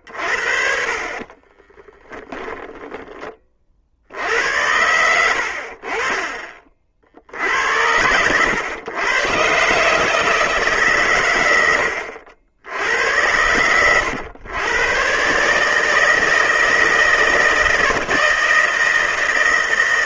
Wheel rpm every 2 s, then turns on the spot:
50, 10, 80, 40, 100, 150, 80, 110, 160, 160.
4-6